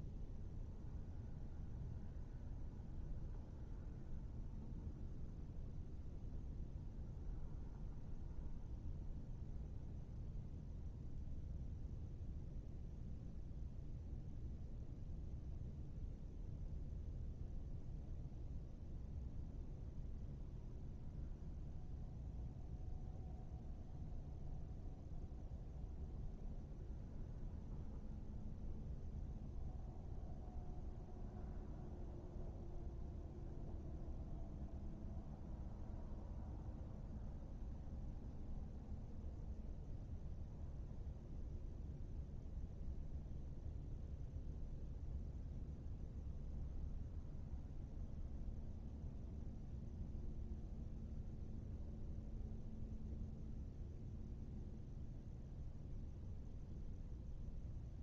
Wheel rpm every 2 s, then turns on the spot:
0, 0, 0, 0, 0, 0, 0, 0, 0, 0, 0, 0, 0, 0, 0, 0, 0, 0, 0, 0, 0, 0, 0, 0, 0, 0, 0, 0, 0.
none